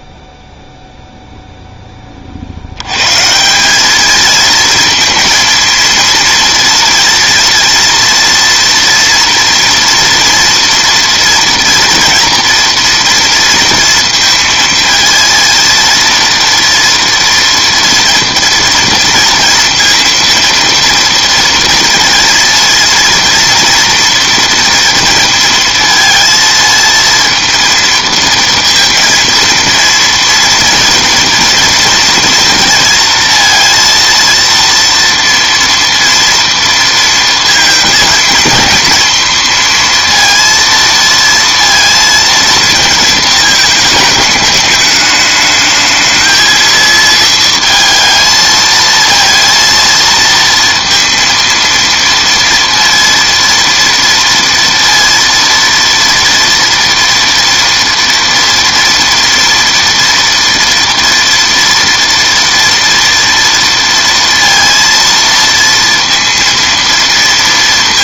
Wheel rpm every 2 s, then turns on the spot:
0, 80, 220, 230, 230, 230, 230, 230, 230, 230, 230, 230, 230, 230, 230, 230, 230, 230, 230, 230, 230, 230, 210, 220, 220, 230, 230, 230, 230, 230, 230, 230, 230, 230.
none